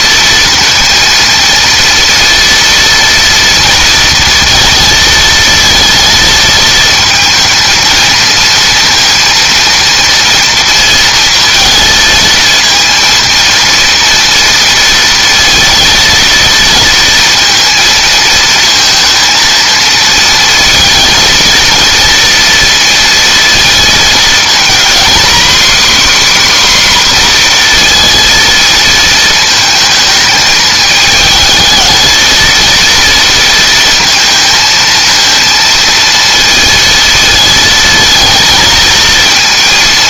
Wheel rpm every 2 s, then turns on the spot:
230, 230, 230, 220, 230, 230, 230, 230, 230, 230, 230, 230, 240, 260, 230, 220, 230, 230, 230, 220.
none